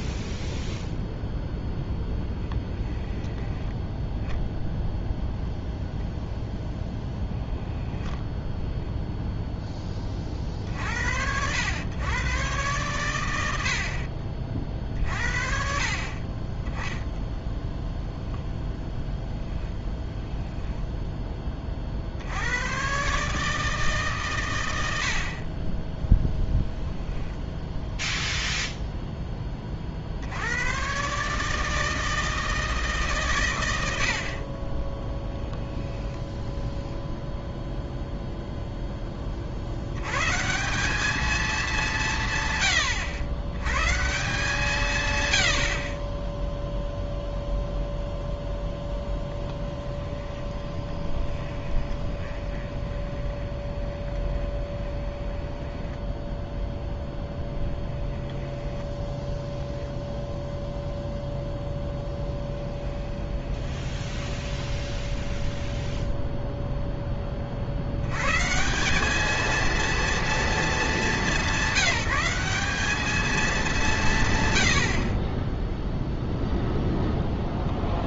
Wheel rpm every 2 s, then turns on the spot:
0, 10, 0, 10, 10, 50, 120, 40, 10, 0, 0, 110, 100, 0, 0, 100, 160, 30, 10, 0, 180, 120, 160, 0, 10, 20, 20, 20, 10, 10, 0, 10, 10, 0, 160, 220, 200, 90, 0.
2-4 50-56 58-60 62-66